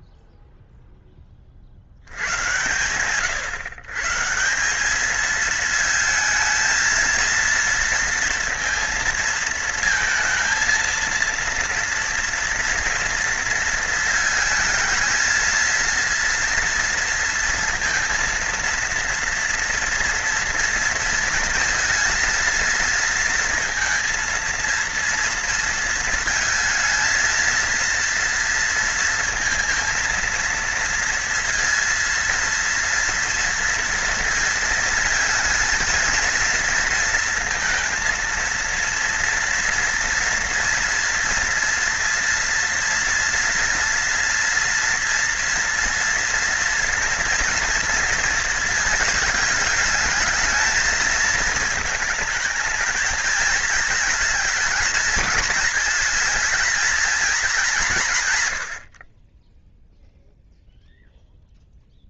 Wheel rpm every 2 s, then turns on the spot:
0, 100, 170, 230, 230, 230, 230, 220, 230, 230, 230, 230, 230, 220, 230, 230, 230, 230, 230, 230, 230, 230, 230, 230, 230, 220, 220, 220, 220, 110, 0.
none